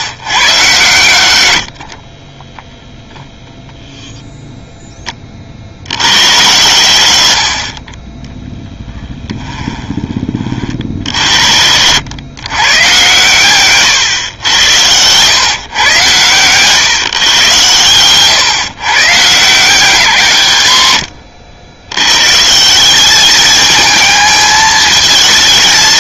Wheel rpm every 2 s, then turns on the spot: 130, 20, 0, 90, 10, 40, 120, 100, 130, 140, 120, 190, 220.
2-4 8-10